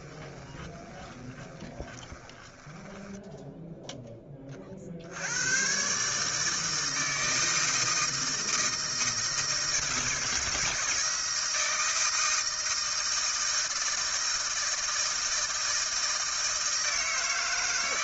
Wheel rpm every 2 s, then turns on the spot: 20, 20, 20, 150, 160, 160, 160, 160, 160.
0-4